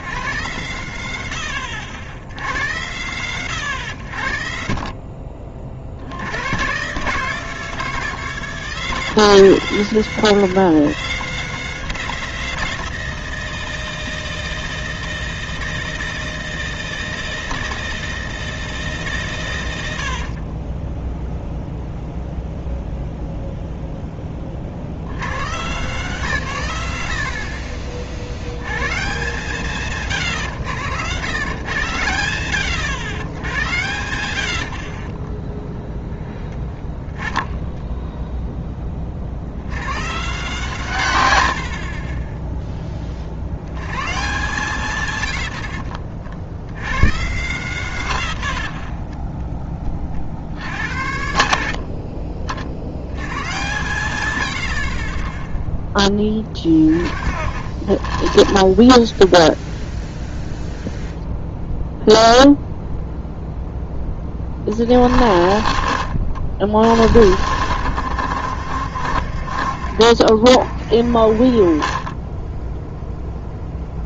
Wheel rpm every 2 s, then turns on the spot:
80, 80, 40, 130, 160, 160, 160, 160, 160, 150, 10, 0, 50, 100, 100, 90, 80, 50, 10, 30, 140, 20, 120, 100, 50, 80, 70, 40, 30, 0, 0, 0, 30, 40, 60, 40, 0.
20-22 34-38 48-50 56-58